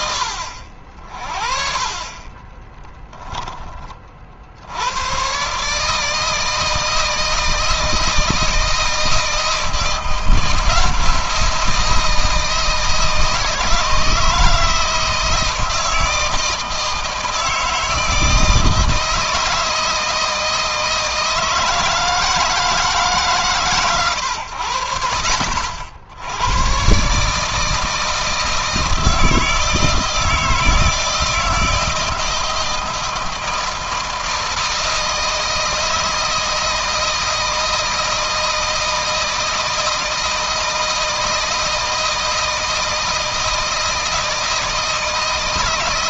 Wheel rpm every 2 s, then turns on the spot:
60, 10, 100, 160, 160, 170, 160, 160, 160, 160, 160, 150, 80, 130, 160, 160, 160, 160, 160, 160, 160, 160, 160.
none